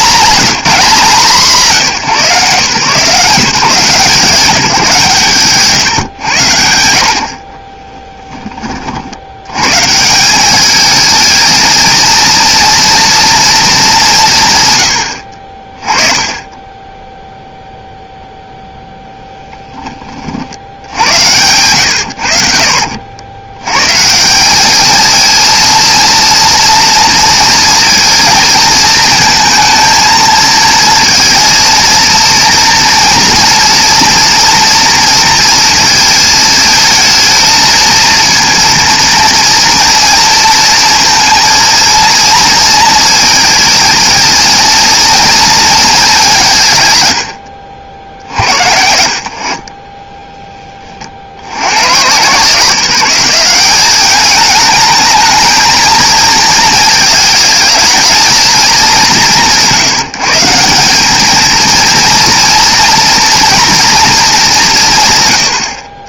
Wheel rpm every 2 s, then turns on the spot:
190, 150, 160, 80, 30, 210, 230, 120, 10, 0, 70, 60, 210, 240, 230, 230, 240, 230, 220, 230, 220, 220, 230, 130, 60, 30, 170, 210, 220, 220, 180, 240, 180.
22-24